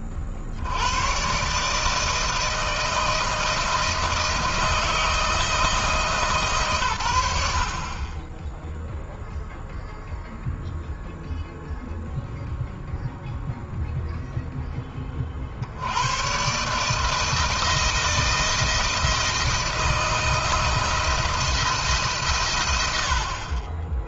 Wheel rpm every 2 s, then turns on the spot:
70, 160, 160, 150, 10, 0, 0, 10, 140, 170, 170, 100.
none